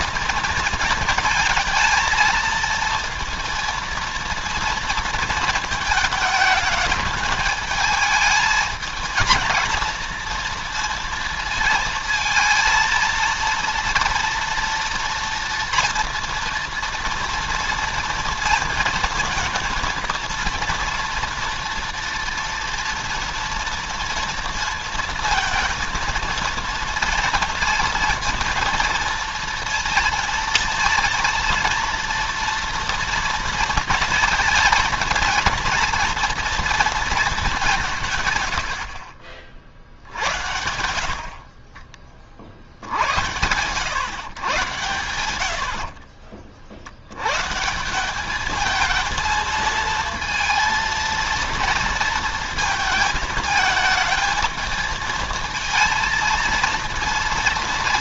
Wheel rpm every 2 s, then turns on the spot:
230, 230, 230, 220, 220, 230, 230, 230, 230, 230, 230, 230, 230, 230, 230, 230, 230, 230, 230, 110, 80, 50, 110, 60, 220, 230, 230, 220, 230.
none